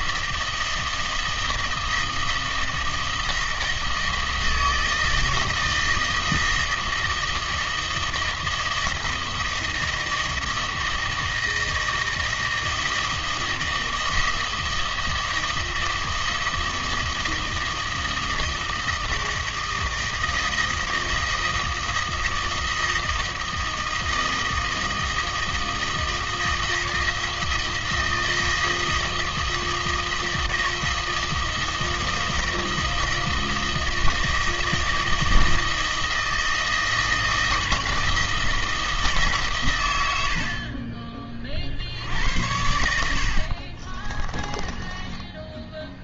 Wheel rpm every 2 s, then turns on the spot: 160, 160, 160, 160, 160, 160, 160, 160, 160, 160, 160, 160, 160, 160, 160, 160, 160, 160, 160, 160, 60, 80, 20.
44-46